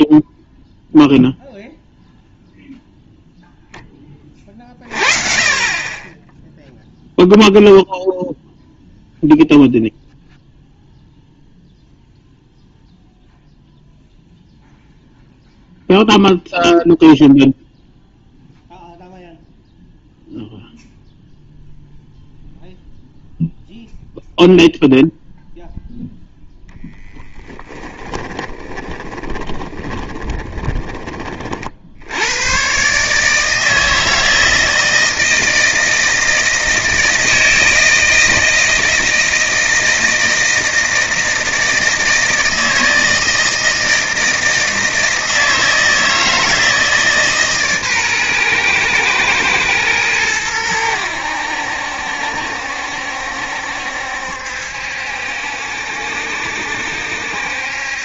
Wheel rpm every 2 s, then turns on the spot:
0, 0, 30, 0, 0, 0, 0, 0, 0, 0, 0, 0, 0, 0, 20, 20, 120, 160, 160, 160, 160, 160, 160, 160, 120, 100, 70, 70, 70.
28-32